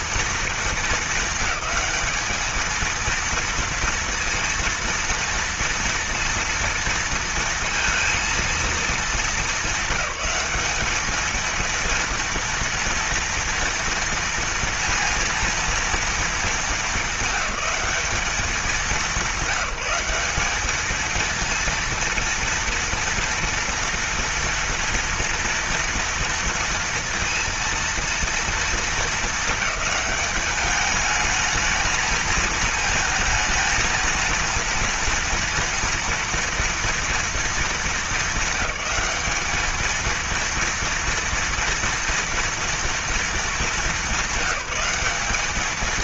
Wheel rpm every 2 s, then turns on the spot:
220, 220, 230, 230, 220, 210, 230, 230, 200, 200, 220, 230, 230, 230, 220, 210, 220, 230, 230, 200, 230, 230, 200.
none